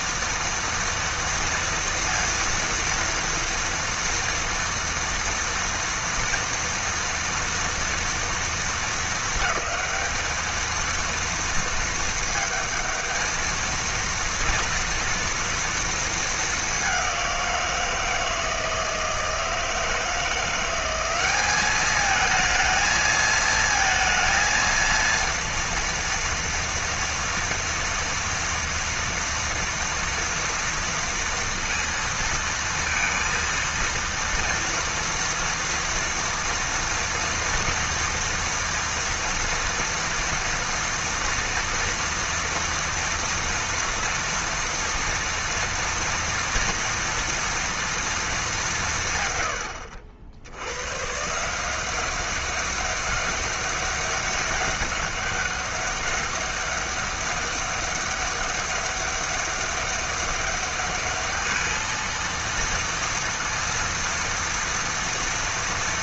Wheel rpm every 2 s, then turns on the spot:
230, 230, 230, 230, 230, 220, 220, 230, 220, 160, 160, 210, 230, 230, 230, 230, 230, 230, 230, 230, 230, 230, 230, 230, 230, 90, 190, 200, 200, 200, 200, 230, 230.
none